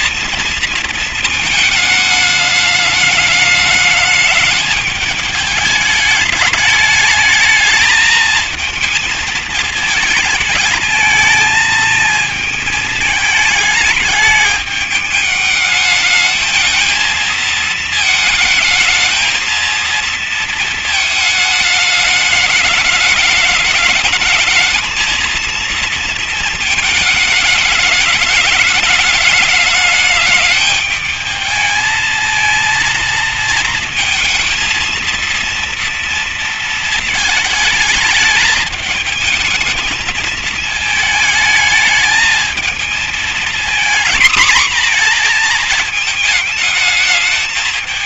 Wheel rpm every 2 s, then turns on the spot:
230, 210, 210, 220, 220, 220, 220, 210, 220, 220, 220, 200, 220, 230, 210, 210, 230, 220, 230, 220, 220, 220, 230, 220.
none